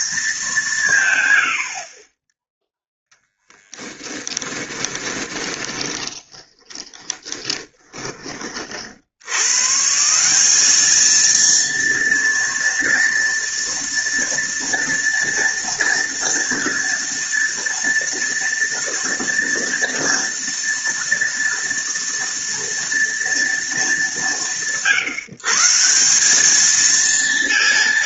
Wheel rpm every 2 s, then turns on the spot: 190, 0, 20, 20, 50, 210, 240, 230, 230, 230, 230, 240, 170, 220.
4-8